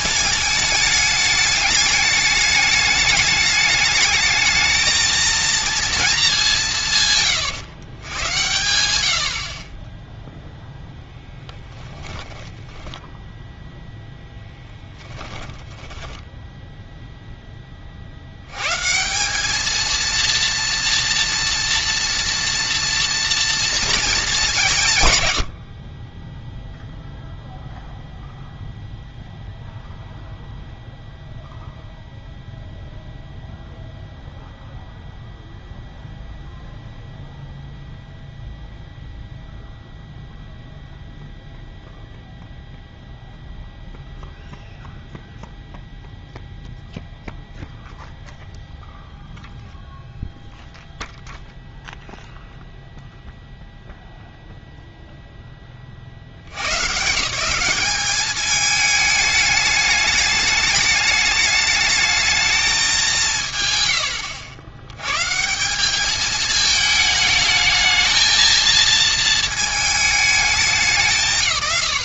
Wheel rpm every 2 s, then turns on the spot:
210, 210, 220, 180, 100, 0, 10, 10, 0, 120, 230, 230, 170, 0, 0, 0, 0, 0, 0, 0, 0, 0, 0, 0, 0, 0, 0, 0, 110, 210, 210, 210, 90, 220, 230, 190.
12-16